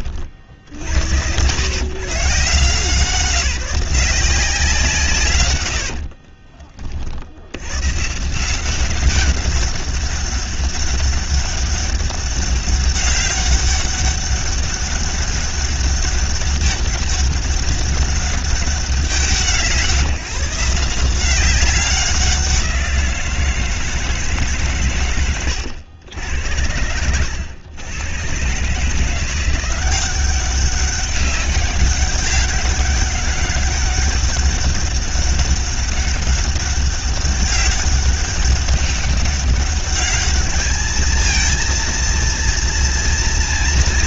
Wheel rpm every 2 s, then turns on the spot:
70, 170, 170, 30, 180, 200, 200, 200, 200, 190, 160, 180, 140, 90, 140, 200, 200, 200, 200, 200, 210, 230.
none